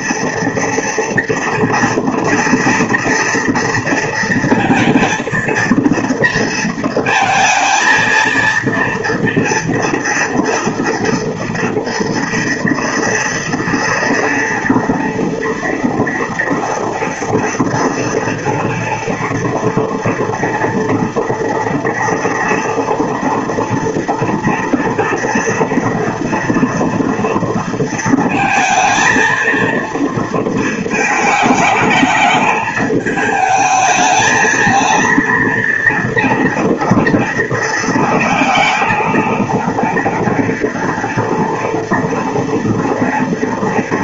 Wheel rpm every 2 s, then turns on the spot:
230, 230, 230, 220, 230, 230, 230, 230, 240, 230, 230, 230, 230, 230, 230, 220, 210, 230, 230, 230, 230, 230.
none